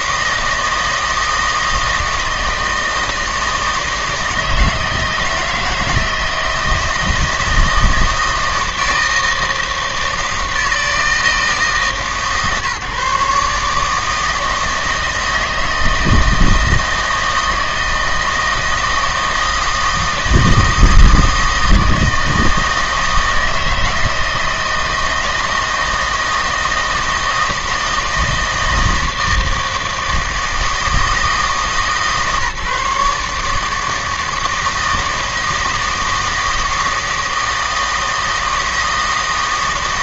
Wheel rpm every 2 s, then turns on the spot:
160, 160, 160, 160, 160, 160, 140, 160, 160, 160, 160, 160, 160, 160, 160, 160, 150, 160, 160, 160.
none